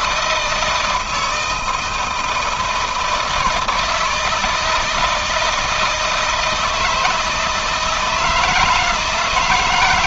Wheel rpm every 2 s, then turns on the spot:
160, 160, 160, 160, 170.
none